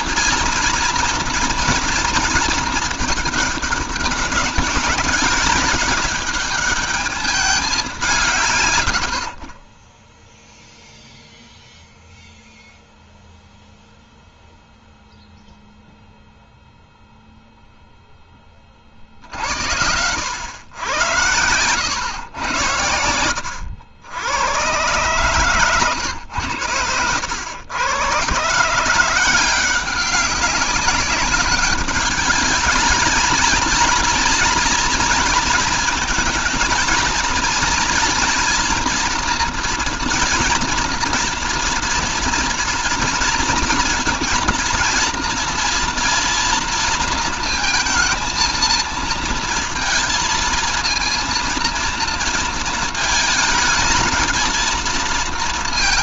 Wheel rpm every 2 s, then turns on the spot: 230, 230, 200, 210, 120, 0, 0, 0, 0, 30, 100, 100, 110, 110, 150, 200, 210, 230, 220, 230, 230, 230, 230, 230, 220, 230, 230, 230.
none